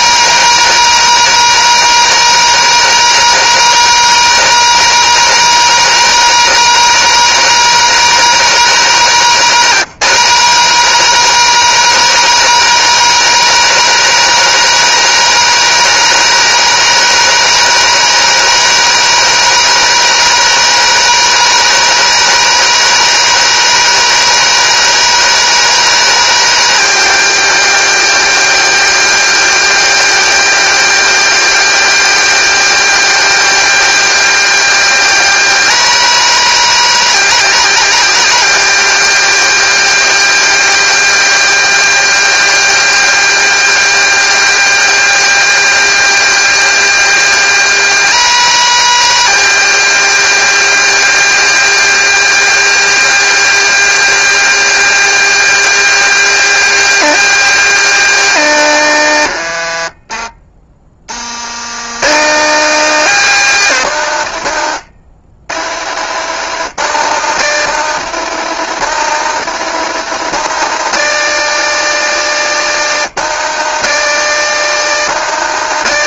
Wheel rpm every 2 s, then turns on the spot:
220, 220, 220, 220, 200, 220, 220, 220, 220, 220, 220, 220, 230, 230, 230, 230, 230, 230, 230, 230, 230, 230, 230, 220, 220, 230, 220, 230, 230, 130, 70, 200, 80, 140, 170, 170, 150, 160.
58-60